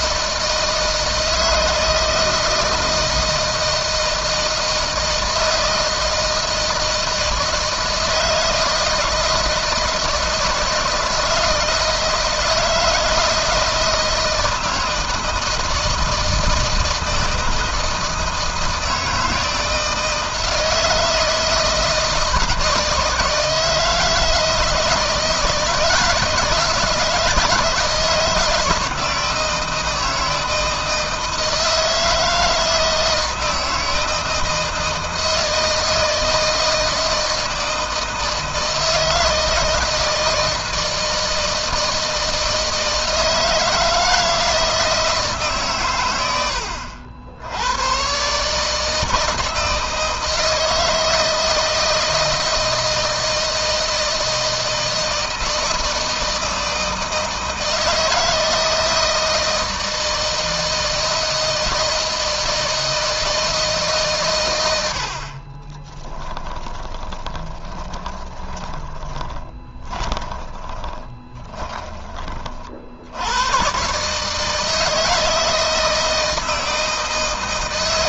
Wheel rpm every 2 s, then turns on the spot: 160, 160, 160, 160, 160, 160, 160, 160, 160, 160, 160, 160, 160, 160, 160, 160, 160, 160, 160, 160, 160, 160, 160, 90, 160, 160, 160, 160, 160, 160, 160, 160, 80, 20, 20, 20, 80, 160, 150.
66-72